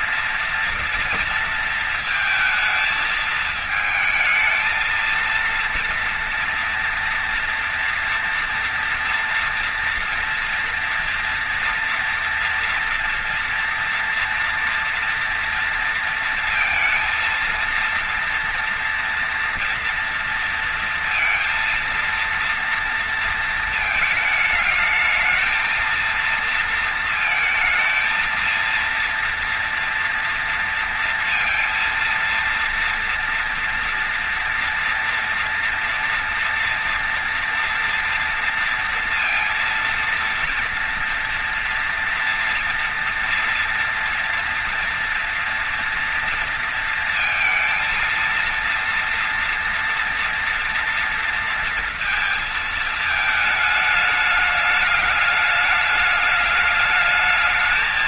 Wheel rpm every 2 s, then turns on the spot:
230, 220, 220, 230, 240, 230, 230, 230, 230, 230, 230, 230, 220, 230, 230, 230, 230, 240, 230, 230, 230, 240, 240, 230, 230, 240, 230, 210, 210.
none